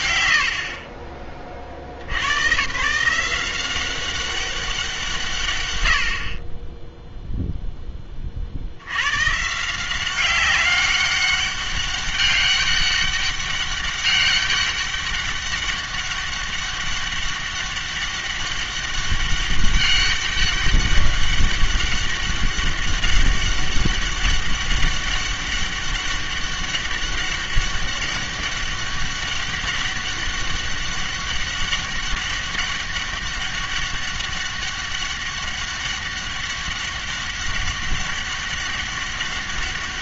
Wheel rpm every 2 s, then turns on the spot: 90, 110, 180, 20, 50, 190, 200, 200, 200, 200, 200, 200, 200, 200, 200, 200, 200, 200, 200, 200.
none